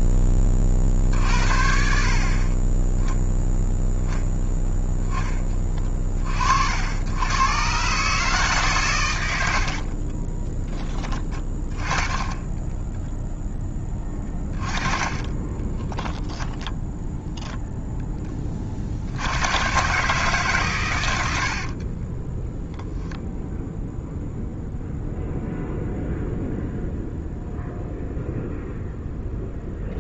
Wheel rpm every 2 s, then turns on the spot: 60, 10, 10, 80, 130, 20, 10, 20, 0, 60, 100, 0, 0, 0, 0.
12-16